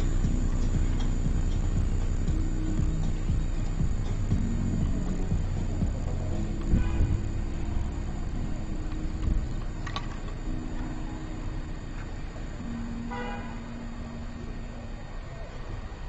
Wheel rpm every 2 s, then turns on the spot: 0, 0, 0, 0, 0, 0, 0, 0.
none